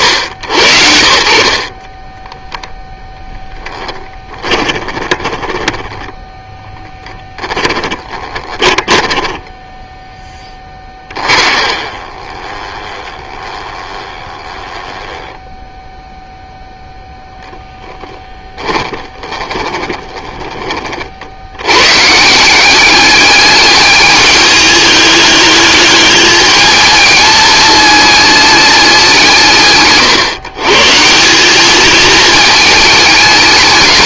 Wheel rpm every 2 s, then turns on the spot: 80, 0, 10, 10, 10, 20, 20, 10, 0, 20, 40, 200, 210, 220, 170, 150, 220.
4-6 8-16 18-20